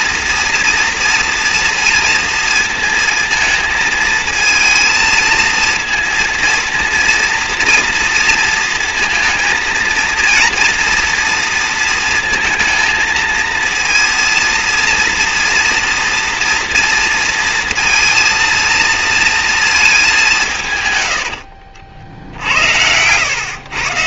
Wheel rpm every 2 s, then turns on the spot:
240, 230, 230, 230, 230, 230, 230, 230, 240, 230, 140, 80.
none